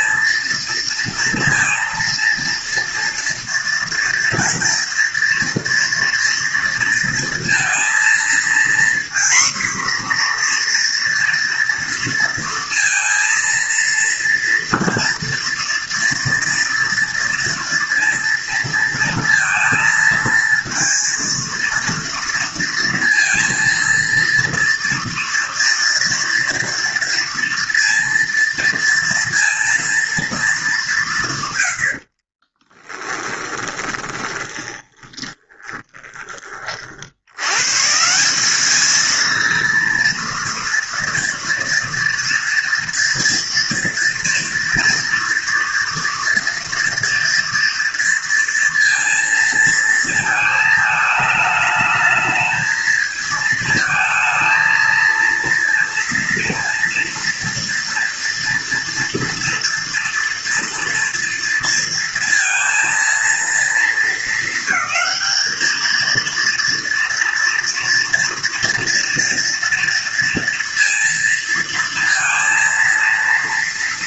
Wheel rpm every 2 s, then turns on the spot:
230, 230, 230, 230, 240, 240, 230, 230, 230, 230, 230, 230, 230, 230, 230, 210, 30, 20, 50, 200, 230, 230, 240, 230, 230, 220, 220, 220, 230, 230, 240, 230, 220, 230, 230, 230, 230.
32-36